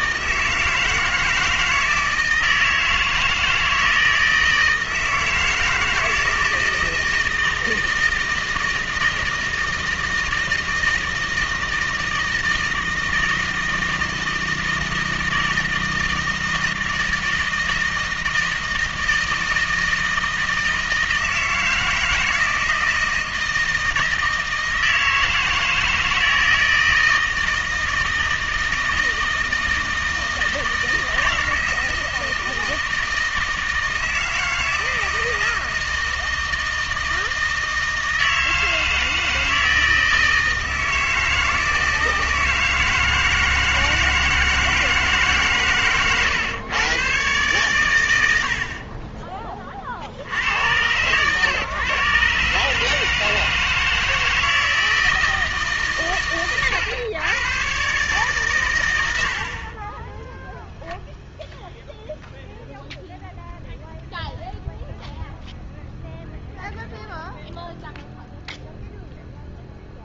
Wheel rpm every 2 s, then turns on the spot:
160, 160, 160, 160, 160, 160, 160, 160, 160, 160, 160, 160, 160, 160, 160, 160, 160, 160, 160, 160, 160, 160, 160, 120, 50, 110, 150, 160, 120, 100, 0, 0, 0, 0, 0.
48-50